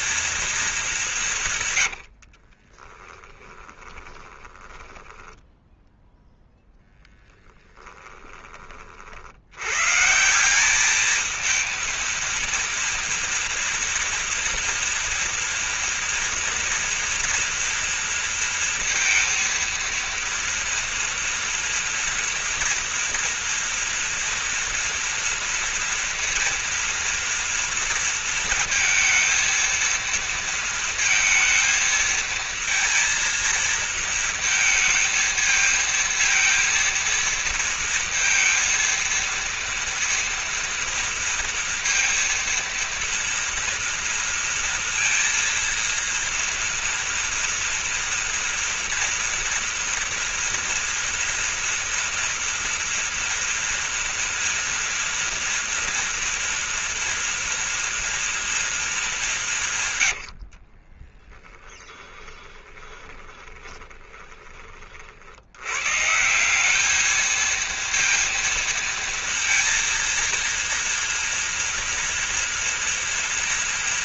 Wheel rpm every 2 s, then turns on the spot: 220, 40, 20, 0, 30, 200, 230, 230, 230, 230, 230, 230, 230, 230, 230, 230, 230, 230, 230, 230, 230, 230, 230, 230, 230, 230, 230, 230, 230, 230, 40, 20, 30, 190, 230, 230, 230.
2-6 60-64